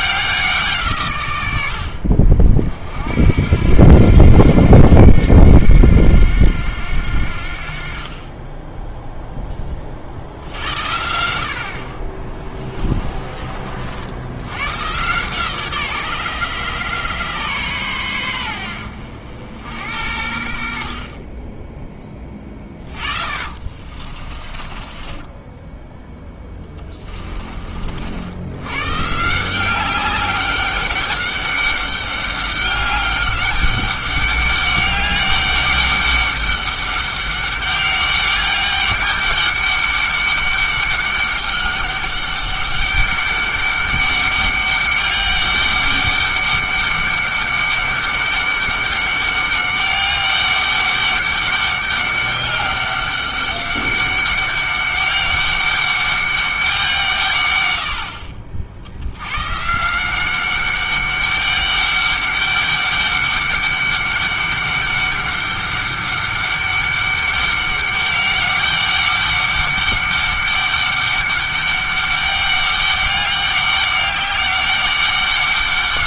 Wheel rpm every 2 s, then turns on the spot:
170, 50, 90, 90, 10, 70, 20, 110, 140, 80, 50, 20, 20, 10, 110, 200, 200, 200, 200, 200, 200, 200, 200, 200, 200, 200, 200, 200, 180, 60, 200, 200, 200, 200, 200, 200, 200, 200.
12-14 22-28